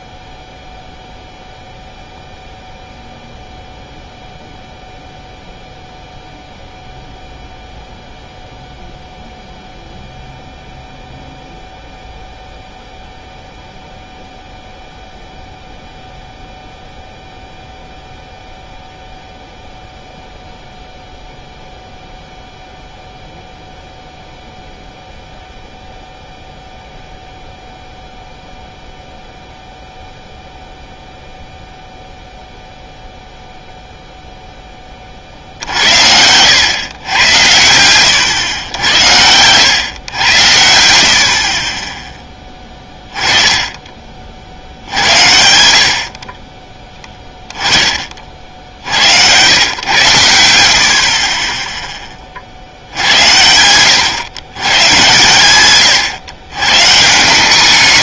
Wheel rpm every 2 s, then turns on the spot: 0, 0, 0, 0, 0, 0, 0, 0, 0, 0, 0, 0, 0, 0, 0, 0, 0, 10, 110, 100, 90, 10, 60, 30, 60, 80, 60, 120, 120.
none